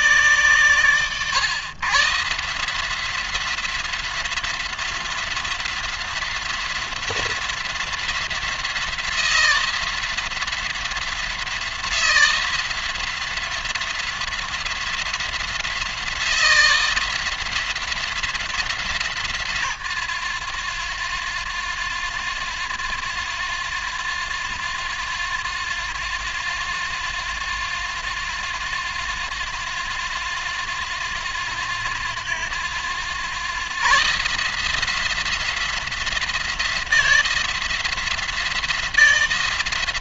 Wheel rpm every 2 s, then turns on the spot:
140, 170, 180, 170, 170, 170, 170, 180, 170, 160, 100, 90, 90, 90, 90, 90, 90, 160, 170, 170.
none